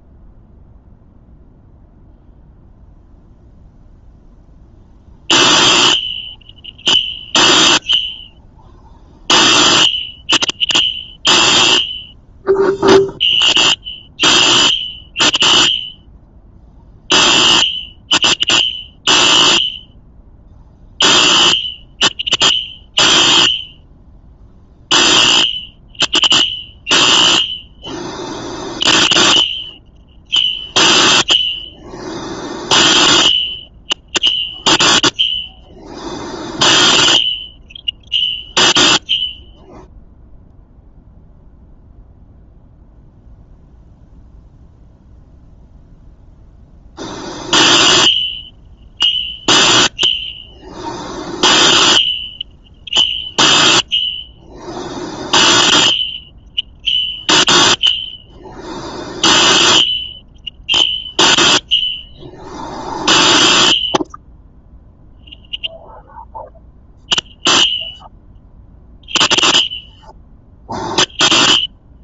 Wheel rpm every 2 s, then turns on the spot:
0, 0, 0, 0, 0, 0, 0, 0, 0, 0, 0, 0, 0, 0, 0, 0, 0, 0, 0, 0, 0, 0, 0, 0, 0, 0, 0, 0, 0, 0, 0, 0, 0, 0, 0, 0.
none